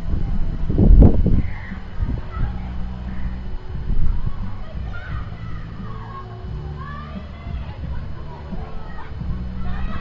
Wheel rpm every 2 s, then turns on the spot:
0, 0, 0, 0, 0.
none